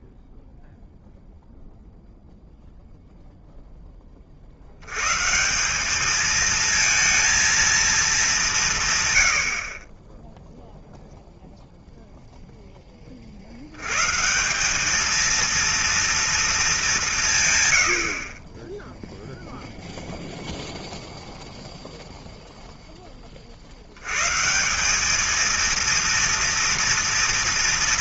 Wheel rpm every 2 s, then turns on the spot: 0, 0, 100, 230, 130, 0, 40, 210, 180, 0, 0, 10, 200, 230.
none